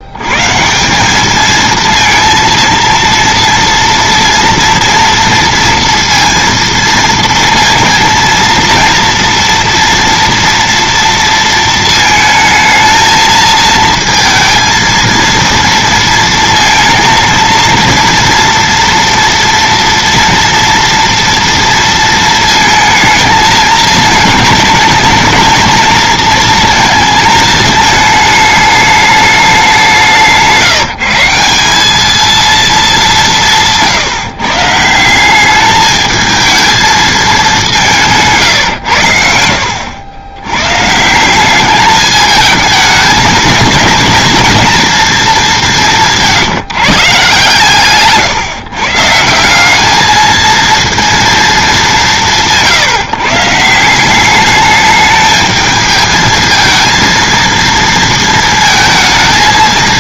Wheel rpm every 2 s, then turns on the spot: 170, 230, 240, 230, 230, 230, 220, 230, 230, 230, 230, 220, 220, 230, 210, 170, 220, 150, 220, 110, 130, 220, 230, 170, 130, 230, 150, 210, 220, 230.
none